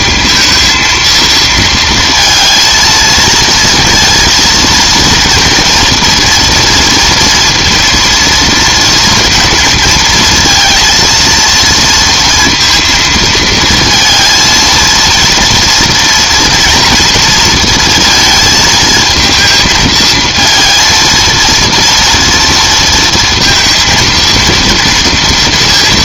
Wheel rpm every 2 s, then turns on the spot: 230, 230, 230, 230, 230, 230, 230, 230, 230, 220, 230, 230, 230.
none